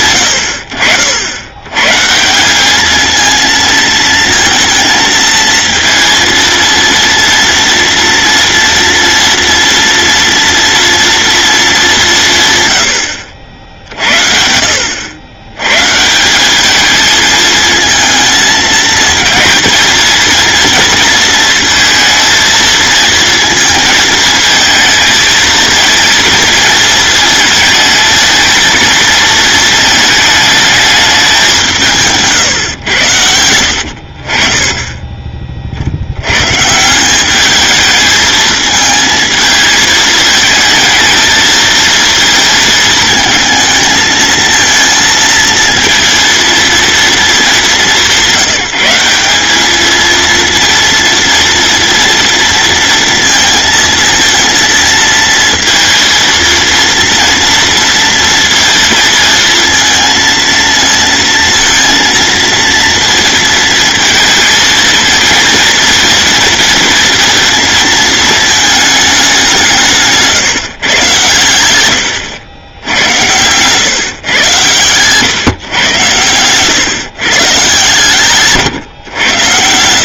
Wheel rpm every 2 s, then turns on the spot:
80, 210, 230, 230, 230, 230, 130, 70, 210, 220, 230, 230, 230, 230, 220, 210, 120, 30, 140, 220, 220, 220, 230, 230, 180, 230, 230, 230, 230, 230, 230, 230, 230, 230, 220, 140, 90, 120, 120, 140.
none